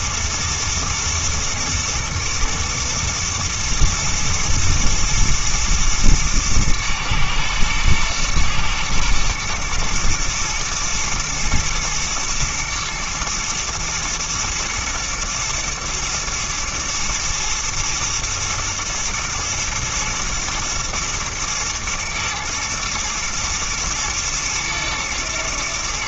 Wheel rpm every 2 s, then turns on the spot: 110, 120, 110, 110, 110, 120, 120, 110, 120, 110, 110, 120, 110.
none